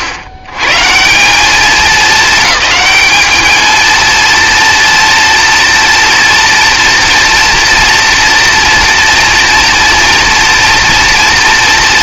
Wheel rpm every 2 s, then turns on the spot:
100, 220, 230, 230, 230, 230.
none